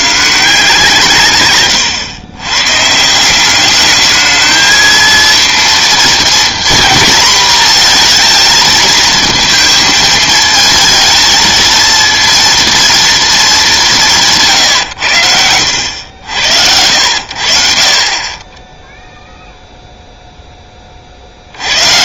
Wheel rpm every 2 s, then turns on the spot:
160, 130, 220, 230, 230, 220, 230, 140, 80, 10, 10.
none